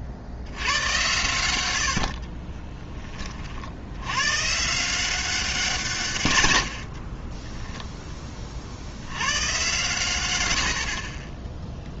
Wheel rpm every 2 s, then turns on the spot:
90, 30, 140, 90, 50, 90.
2-4